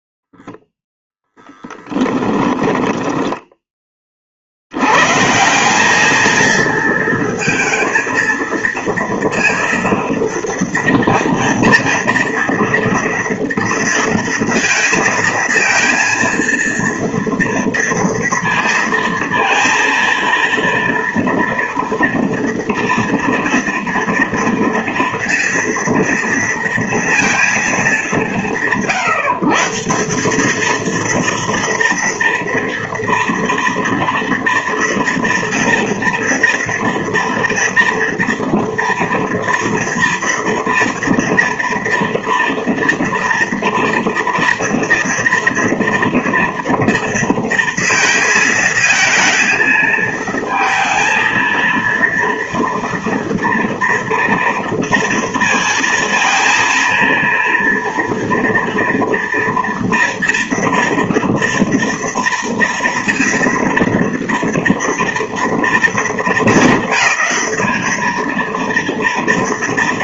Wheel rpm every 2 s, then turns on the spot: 0, 20, 60, 220, 230, 230, 230, 230, 230, 230, 230, 230, 230, 230, 130, 220, 230, 230, 230, 230, 230, 230, 230, 230, 220, 220, 230, 230, 230, 240, 230, 230, 230, 220, 230.
2-4